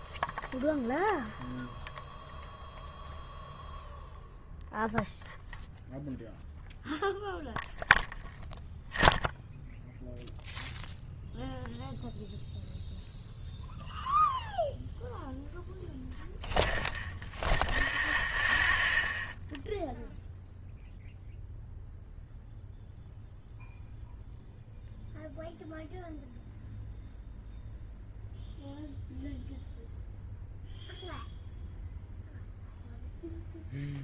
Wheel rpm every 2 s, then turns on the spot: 0, 0, 0, 0, 0, 0, 0, 0, 0, 0, 0, 0, 0, 0, 0, 0, 0.
none